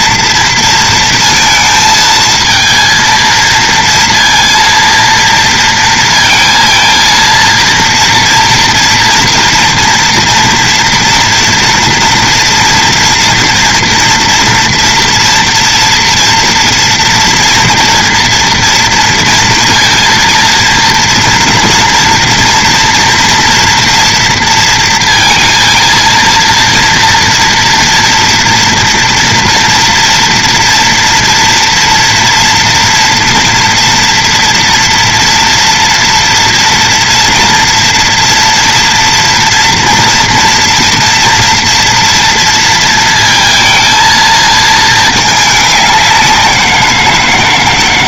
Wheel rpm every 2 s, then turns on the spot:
230, 220, 230, 220, 230, 230, 230, 230, 230, 240, 230, 230, 230, 230, 230, 230, 230, 230, 230, 230, 230, 230, 220, 180.
none